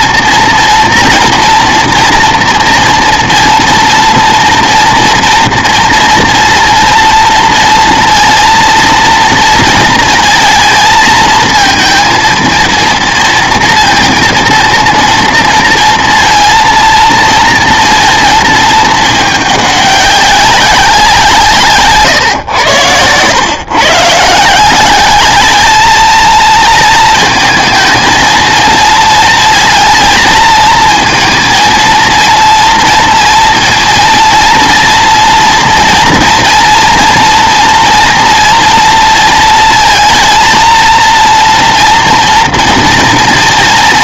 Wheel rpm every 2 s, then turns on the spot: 240, 230, 230, 230, 230, 230, 230, 230, 230, 220, 190, 110, 180, 220, 230, 230, 230, 240, 230, 230, 230, 230.
none